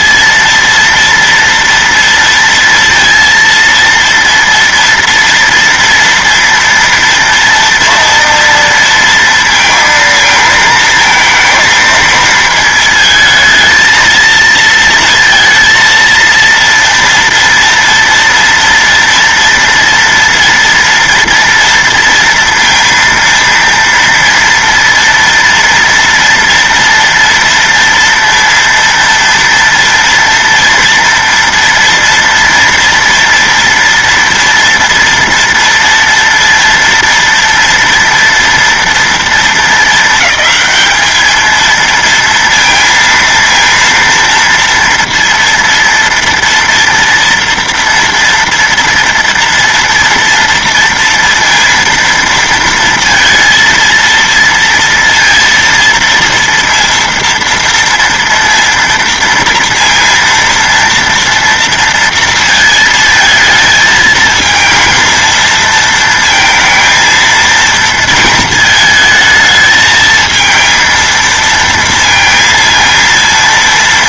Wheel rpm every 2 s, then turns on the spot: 230, 230, 230, 230, 230, 220, 220, 230, 230, 230, 240, 230, 230, 230, 230, 230, 230, 230, 230, 230, 220, 230, 230, 230, 230, 230, 230, 230, 230, 230, 230, 230, 230, 230, 230, 220, 230.
none